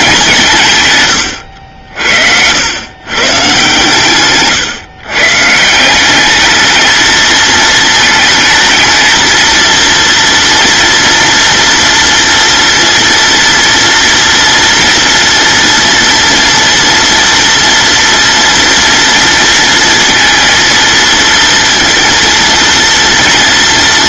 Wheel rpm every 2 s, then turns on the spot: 110, 130, 140, 220, 220, 230, 230, 230, 230, 230, 230, 230.
none